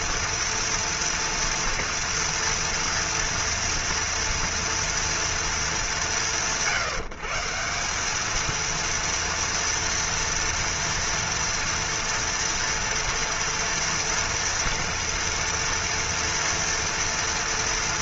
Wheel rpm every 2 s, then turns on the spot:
230, 230, 230, 140, 230, 230, 230, 230, 230.
none